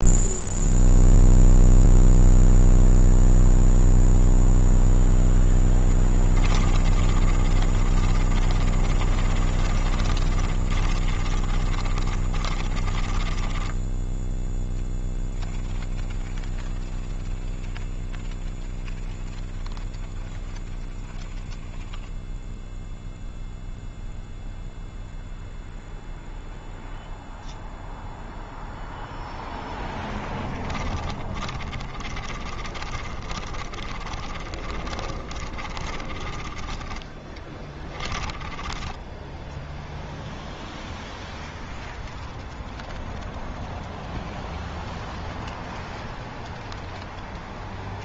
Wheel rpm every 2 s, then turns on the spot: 0, 0, 0, 20, 30, 30, 20, 0, 0, 0, 0, 0, 0, 0, 0, 20, 30, 30, 30, 10, 0, 0, 0, 0.
6-14 30-40